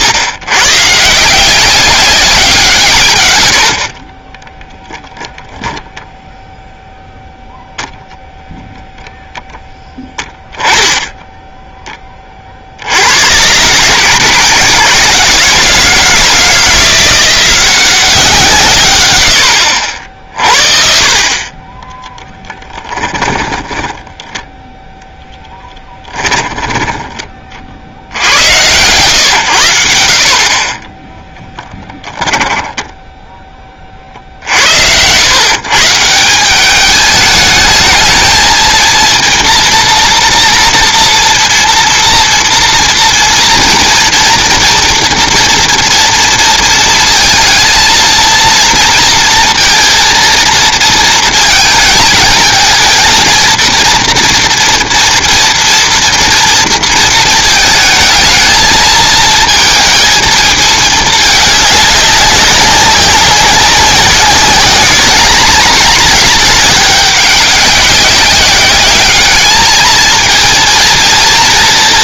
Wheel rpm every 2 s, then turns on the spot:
110, 170, 0, 0, 0, 10, 50, 160, 170, 140, 60, 10, 10, 20, 100, 30, 10, 80, 190, 220, 230, 230, 230, 220, 230, 230, 220, 240, 230, 220, 220, 190, 200, 210, 200, 230.
22-24 32-34